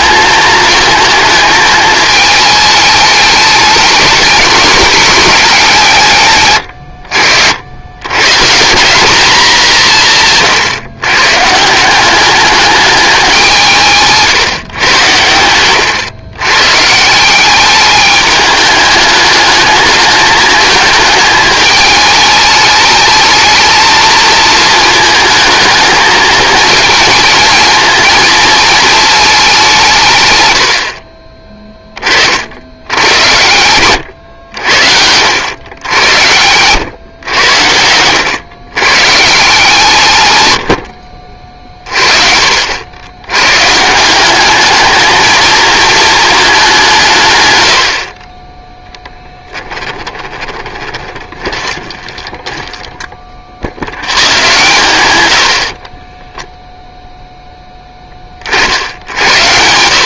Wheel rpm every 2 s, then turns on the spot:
220, 220, 210, 100, 180, 150, 210, 120, 130, 210, 210, 210, 220, 220, 220, 80, 90, 80, 110, 110, 100, 60, 210, 200, 20, 20, 10, 120, 0, 50.
30-32 50-54